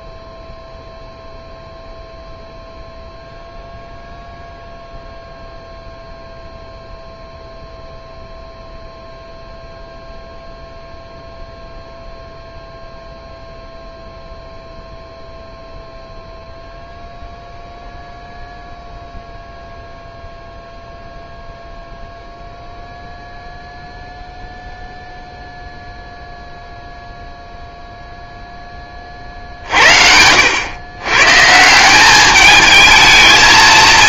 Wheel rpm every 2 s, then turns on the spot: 0, 0, 0, 0, 0, 0, 0, 0, 0, 0, 0, 0, 0, 0, 10, 90, 210.
none